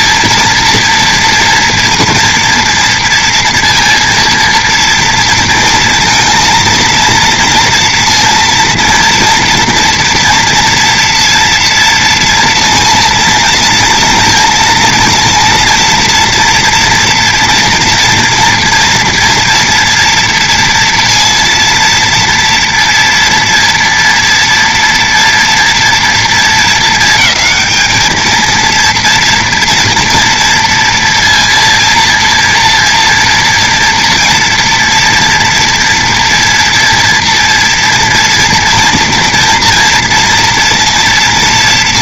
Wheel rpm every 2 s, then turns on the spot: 230, 230, 230, 230, 230, 240, 230, 230, 230, 230, 230, 230, 230, 220, 230, 230, 230, 230, 230, 230, 230.
none